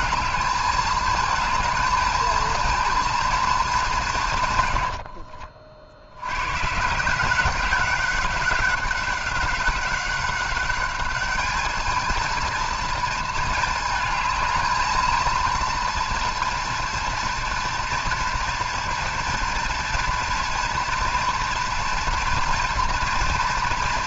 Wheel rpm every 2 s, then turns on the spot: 220, 230, 90, 140, 200, 200, 230, 220, 230, 230, 230, 230.
4-6